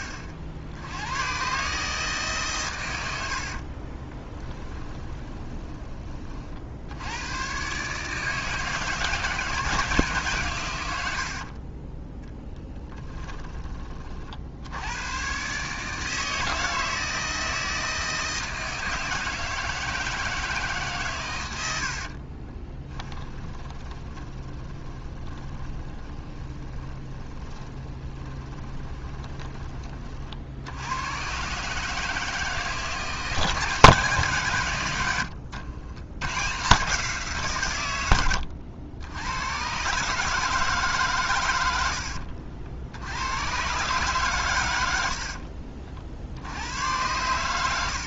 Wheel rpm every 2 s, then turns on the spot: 80, 110, 20, 80, 160, 100, 10, 90, 160, 160, 140, 20, 20, 10, 20, 90, 160, 100, 150, 80, 150, 70, 90, 100.
4-6 12-14 22-30